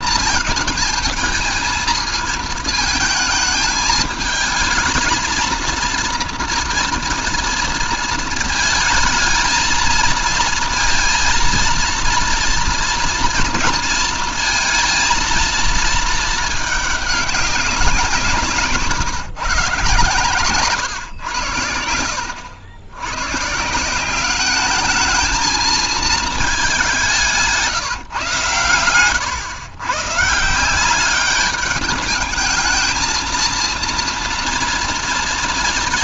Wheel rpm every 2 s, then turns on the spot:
220, 220, 220, 230, 220, 230, 230, 230, 200, 140, 100, 120, 220, 190, 110, 200, 220, 230.
none